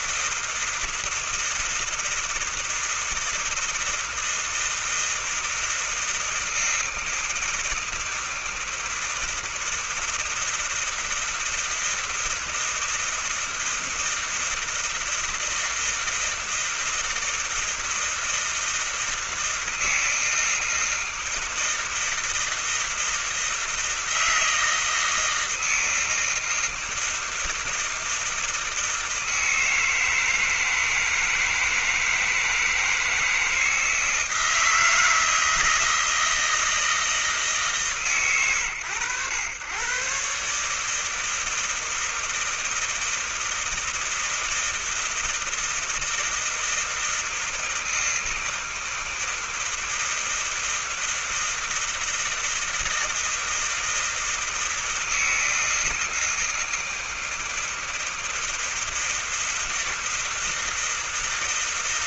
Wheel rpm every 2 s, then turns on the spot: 160, 160, 160, 160, 160, 160, 160, 160, 160, 160, 160, 170, 160, 160, 160, 160, 160, 160, 160, 130, 120, 160, 160, 160, 160, 160, 160, 160, 160, 160, 160.
none